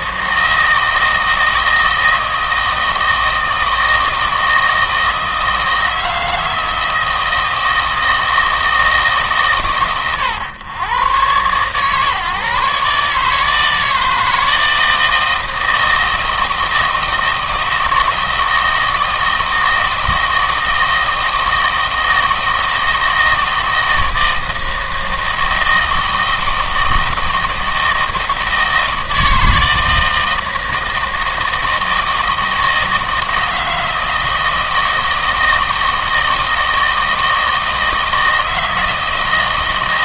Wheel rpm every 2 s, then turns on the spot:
160, 160, 160, 160, 160, 120, 140, 160, 160, 160, 160, 160, 160, 160, 160, 160, 160, 160, 160, 160.
none